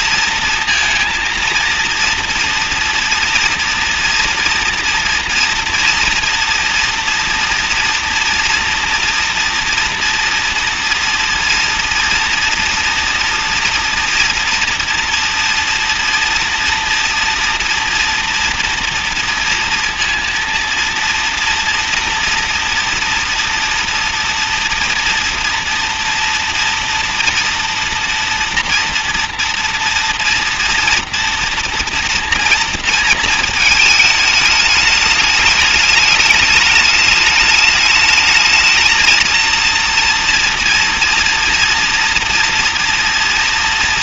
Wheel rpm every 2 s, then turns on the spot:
230, 230, 240, 240, 230, 230, 230, 230, 230, 240, 230, 230, 230, 240, 230, 230, 230, 210, 220, 220, 230, 230.
none